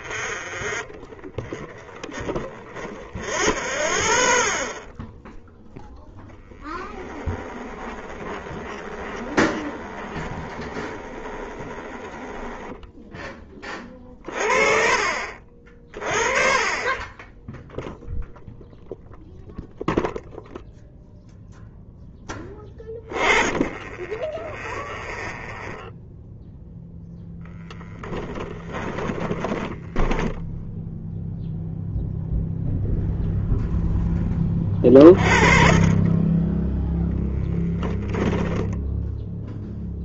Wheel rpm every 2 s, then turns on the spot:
20, 0, 10, 20, 20, 10, 40, 20, 0, 0, 10, 0, 0, 10, 10, 0, 20, 10, 10, 20.
0-2 4-12 26-30 36-38